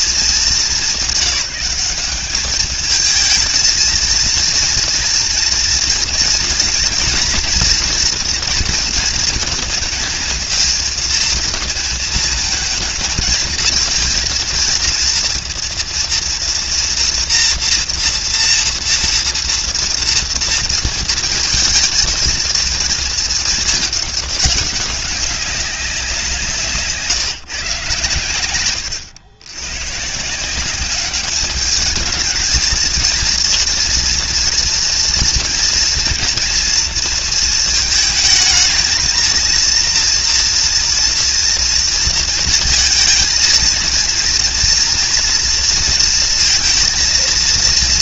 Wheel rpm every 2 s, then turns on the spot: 190, 210, 240, 240, 230, 230, 220, 230, 240, 230, 230, 230, 200, 150, 110, 190, 220, 230, 230, 220, 230, 230, 240, 230.
none